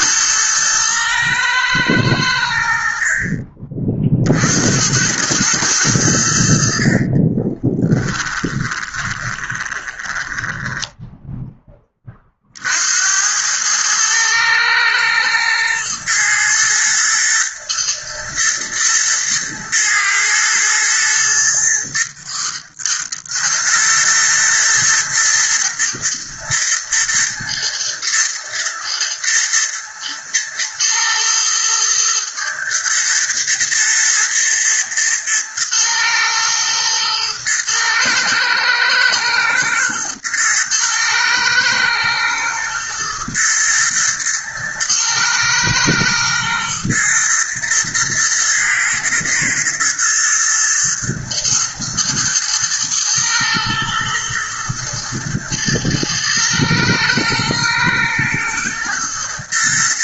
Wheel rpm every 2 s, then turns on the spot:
110, 50, 90, 50, 20, 10, 70, 110, 120, 110, 110, 120, 110, 110, 110, 110, 120, 110, 110, 110, 110, 120, 110, 110, 110, 110, 110, 110, 110, 120.
6-12